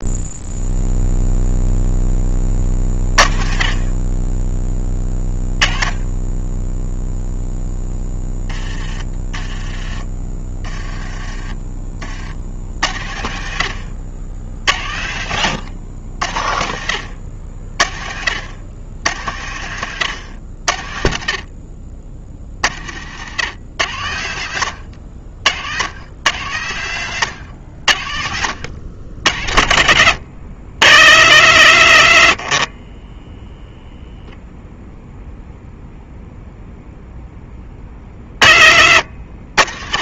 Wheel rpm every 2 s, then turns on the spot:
0, 30, 10, 10, 20, 20, 70, 70, 70, 100, 60, 70, 80, 100, 80, 80, 30, 0, 0, 60.
8-12 32-34